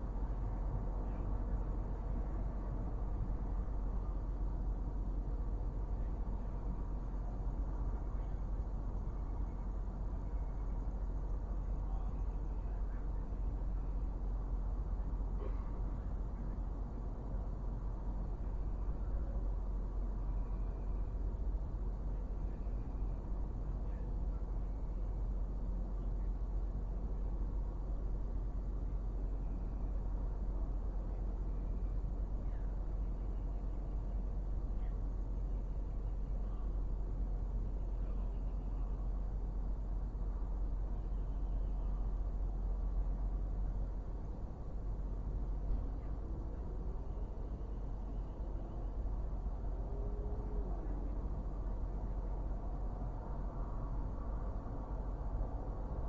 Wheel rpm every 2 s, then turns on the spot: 0, 0, 0, 0, 0, 0, 0, 0, 0, 0, 0, 0, 0, 0, 0, 0, 0, 0, 0, 0, 0, 0, 0, 0, 0, 0, 0, 0.
none